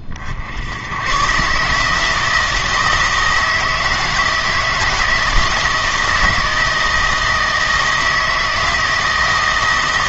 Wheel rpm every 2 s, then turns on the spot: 100, 160, 160, 160, 160.
none